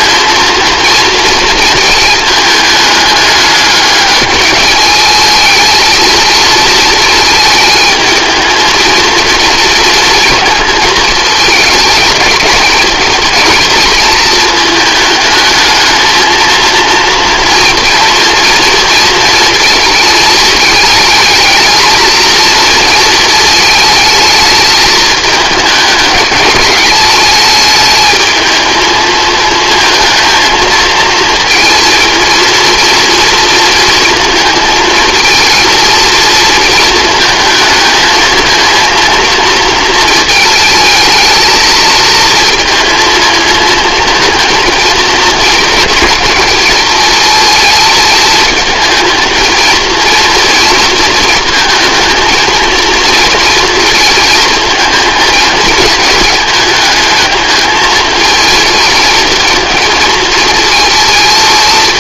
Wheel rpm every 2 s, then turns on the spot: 230, 210, 230, 220, 230, 220, 220, 220, 230, 230, 220, 220, 210, 220, 220, 230, 230, 230, 220, 220, 220, 230, 220, 220, 230, 230, 230, 220, 220, 220, 220.
none